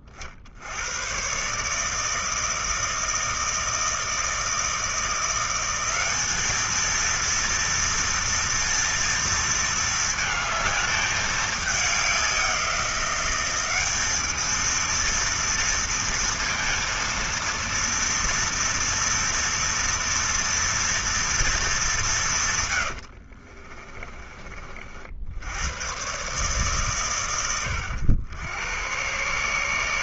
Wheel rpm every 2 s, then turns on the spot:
80, 160, 160, 220, 230, 220, 180, 230, 230, 230, 230, 120, 40, 130, 100.
22-24